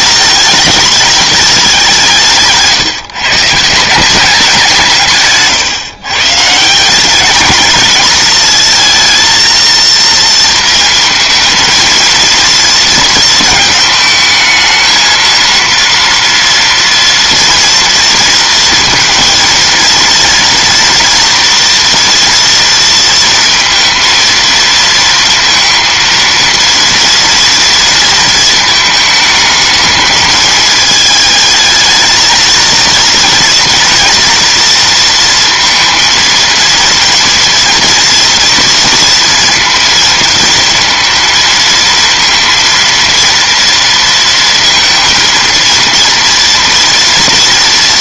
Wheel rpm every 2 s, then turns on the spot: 210, 150, 170, 170, 230, 230, 230, 220, 230, 230, 230, 230, 230, 230, 220, 220, 220, 230, 230, 230, 230, 230, 230, 230.
none